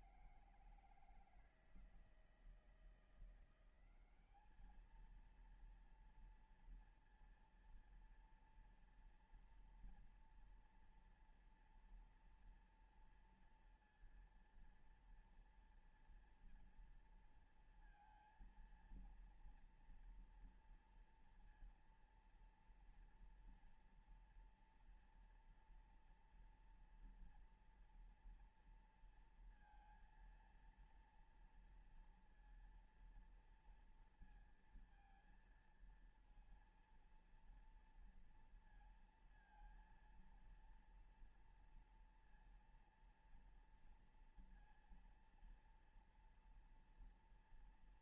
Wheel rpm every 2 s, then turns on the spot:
160, 160, 200, 230, 230, 230, 230, 230, 240, 230, 230, 230, 230, 240, 230, 230, 230, 230, 230, 230, 230, 230, 230, 230.
none